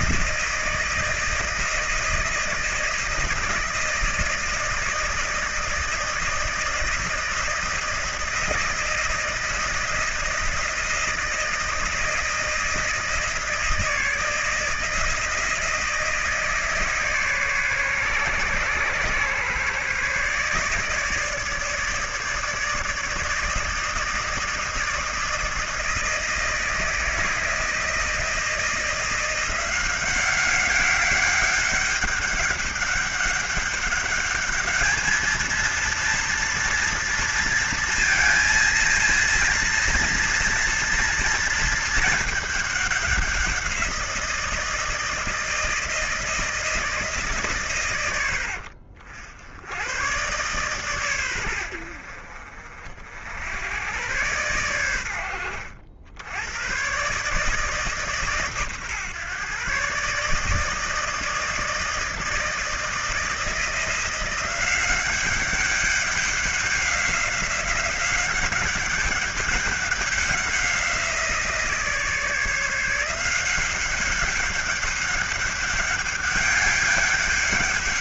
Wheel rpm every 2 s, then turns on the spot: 160, 160, 160, 160, 160, 160, 160, 160, 160, 130, 150, 160, 160, 160, 160, 200, 200, 210, 230, 230, 230, 210, 170, 160, 80, 130, 50, 110, 100, 140, 150, 160, 180, 190, 190, 190, 160, 190, 200.
none